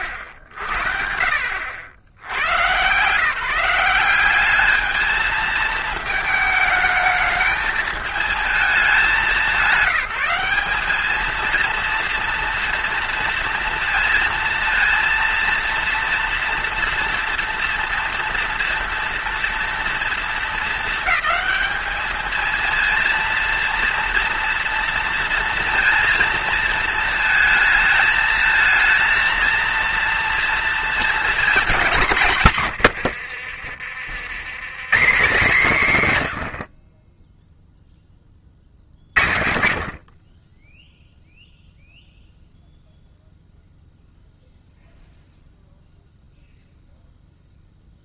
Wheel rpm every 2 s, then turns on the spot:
70, 120, 210, 220, 210, 200, 230, 230, 230, 230, 220, 220, 230, 230, 220, 230, 120, 140, 50, 30, 10, 0, 0, 0.
32-34 40-42